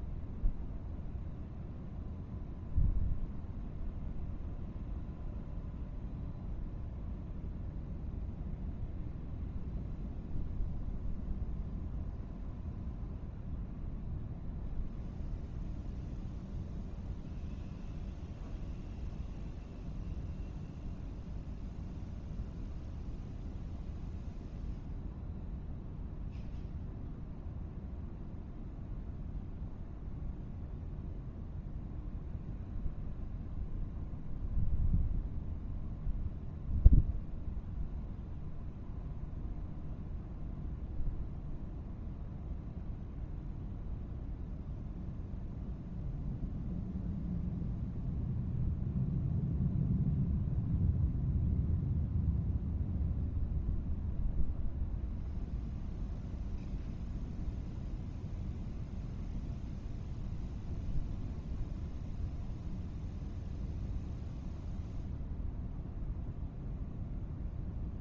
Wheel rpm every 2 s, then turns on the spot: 0, 0, 0, 0, 0, 0, 0, 0, 0, 0, 0, 0, 0, 0, 0, 0, 0, 0, 0, 0, 0, 0, 0, 0, 0, 0, 0, 0, 0, 0, 0, 0, 0, 0.
none